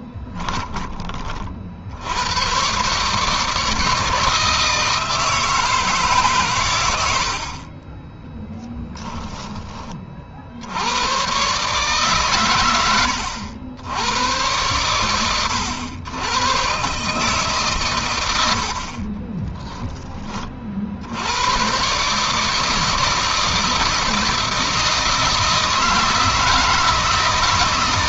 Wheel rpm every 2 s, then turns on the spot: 20, 130, 160, 100, 10, 80, 100, 100, 130, 40, 60, 160, 160, 160.
18-20